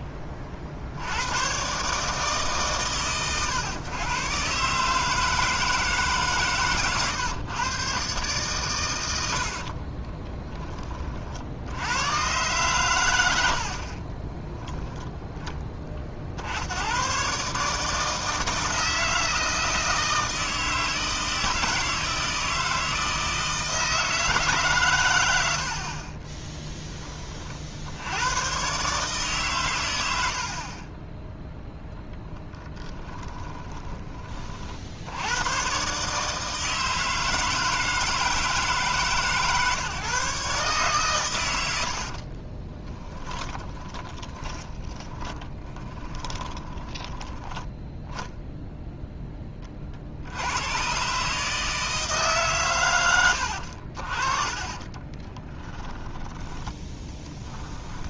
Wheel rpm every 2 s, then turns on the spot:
40, 130, 140, 130, 110, 20, 110, 10, 80, 160, 160, 160, 130, 10, 130, 40, 10, 60, 150, 150, 140, 20, 20, 20, 0, 100, 130, 30, 10.
32-34 42-48 54-56